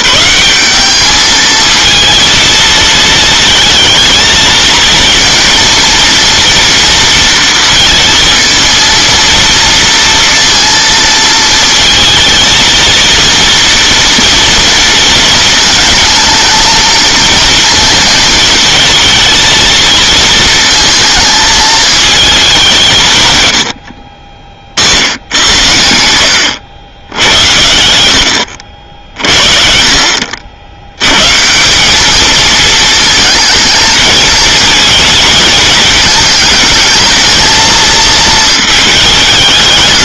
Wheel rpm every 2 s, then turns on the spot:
210, 220, 230, 230, 220, 230, 230, 230, 230, 230, 230, 180, 60, 110, 70, 80, 220, 220, 220, 210.
none